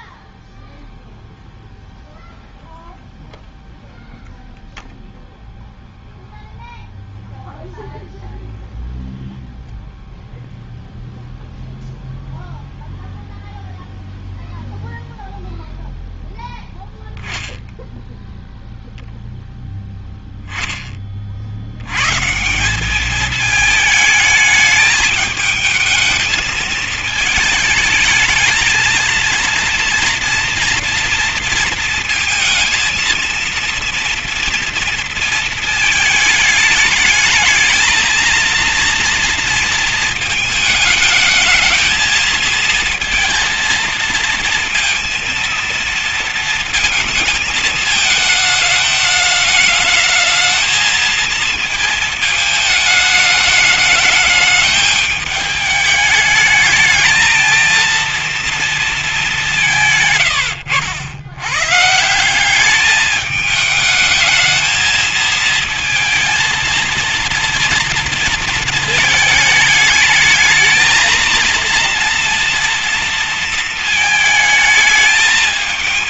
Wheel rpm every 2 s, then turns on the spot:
0, 0, 0, 0, 0, 0, 0, 0, 0, 0, 10, 160, 220, 220, 220, 230, 230, 230, 210, 230, 220, 230, 220, 220, 220, 220, 220, 210, 210, 230, 120, 190, 220, 220, 220, 220, 230, 220.
none